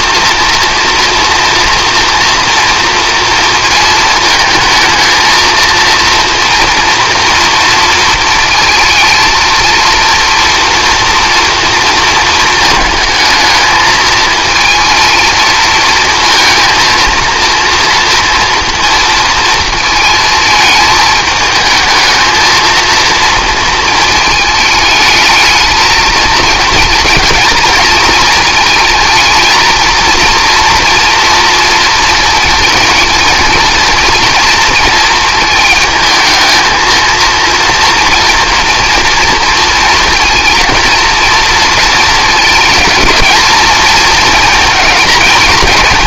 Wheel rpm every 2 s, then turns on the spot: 230, 230, 220, 230, 220, 230, 220, 230, 230, 230, 220, 230, 210, 230, 230, 230, 230, 230, 220, 230, 230, 220, 220.
none